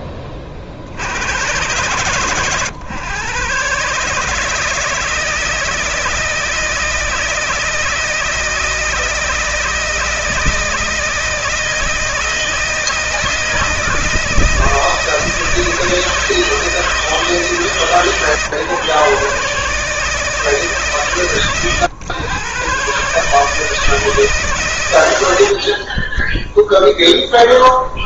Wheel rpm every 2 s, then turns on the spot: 40, 120, 160, 160, 160, 160, 160, 160, 160, 140, 140, 140, 130, 0.
none